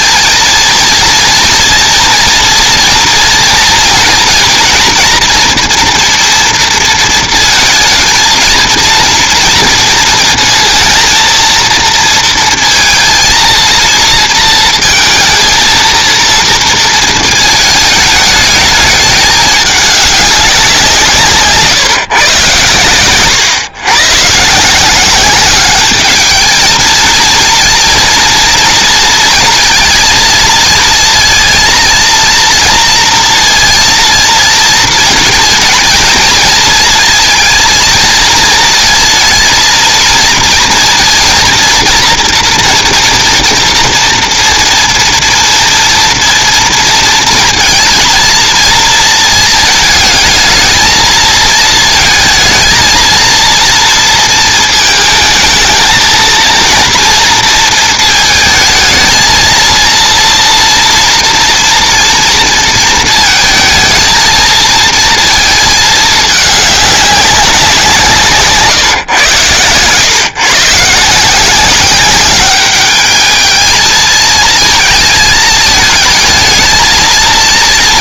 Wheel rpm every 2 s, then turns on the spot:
230, 240, 230, 230, 230, 230, 230, 230, 230, 210, 180, 120, 170, 230, 230, 230, 230, 230, 220, 220, 230, 230, 230, 230, 220, 230, 230, 220, 230, 220, 230, 230, 230, 200, 150, 150, 210, 220, 220.
none